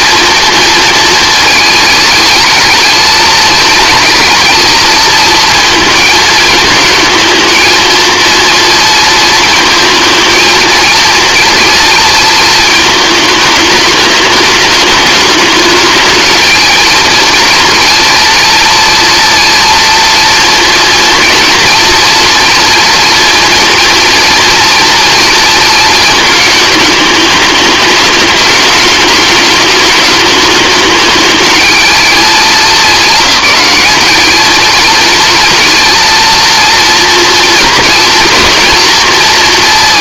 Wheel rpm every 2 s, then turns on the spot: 230, 220, 230, 220, 230, 220, 220, 210, 230, 230, 230, 240, 230, 220, 210, 210, 200, 220, 230, 240.
none